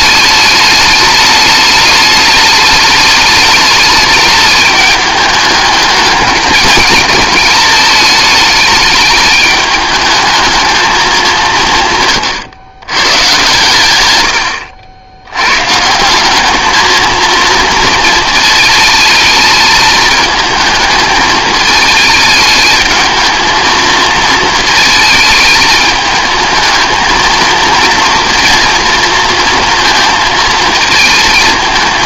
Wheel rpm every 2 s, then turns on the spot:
210, 210, 210, 210, 210, 220, 120, 80, 220, 220, 220, 220, 220, 220, 230, 220.
none